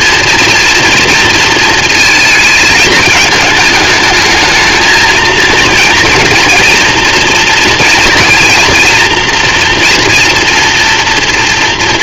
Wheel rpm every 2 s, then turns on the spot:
230, 220, 220, 230, 230, 240.
none